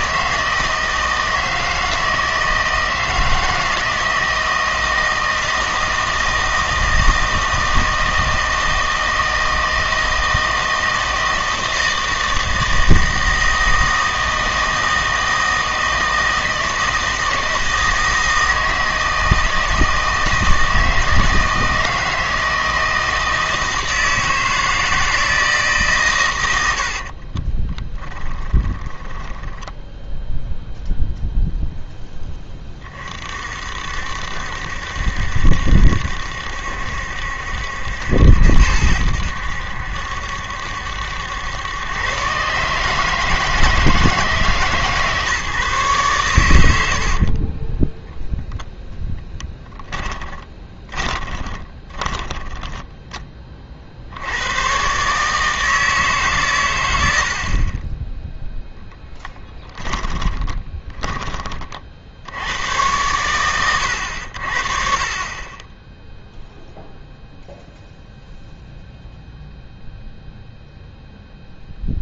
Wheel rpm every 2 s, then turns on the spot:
160, 160, 160, 160, 160, 160, 160, 160, 160, 160, 160, 160, 160, 80, 10, 0, 20, 70, 70, 80, 70, 140, 150, 90, 0, 20, 20, 110, 110, 0, 20, 100, 50, 0, 0, 0.
26-30 50-54 60-62